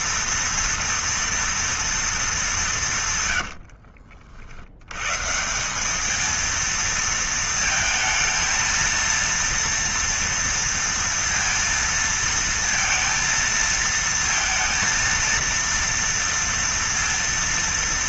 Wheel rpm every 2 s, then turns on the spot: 230, 170, 110, 230, 230, 230, 230, 230, 230.
none